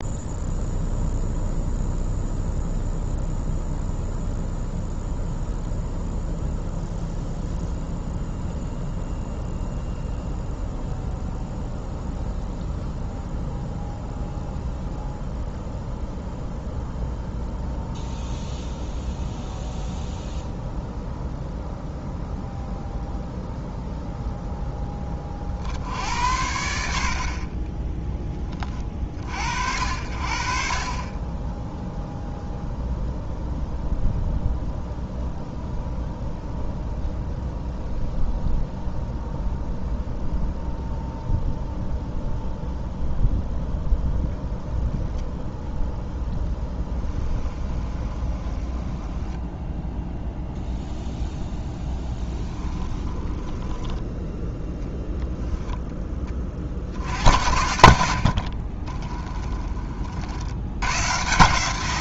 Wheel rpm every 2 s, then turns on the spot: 0, 0, 0, 0, 0, 0, 0, 0, 0, 0, 0, 0, 10, 60, 40, 30, 0, 0, 0, 0, 0, 0, 10, 10, 10, 0, 20, 10, 60, 30, 100.
44-50 52-54 58-60